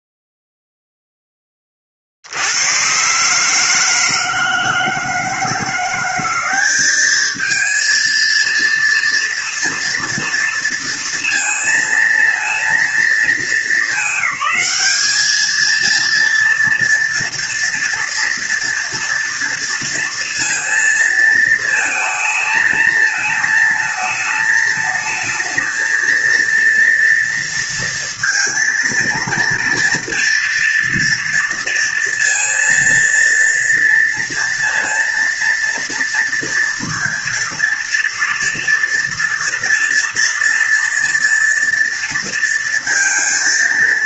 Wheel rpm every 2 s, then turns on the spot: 0, 110, 160, 200, 230, 230, 230, 210, 230, 240, 230, 220, 220, 230, 230, 230, 230, 230, 230, 230, 230, 230.
none